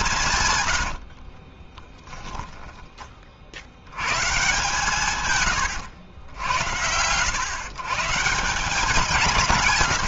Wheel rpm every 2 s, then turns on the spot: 140, 10, 150, 100, 170.
none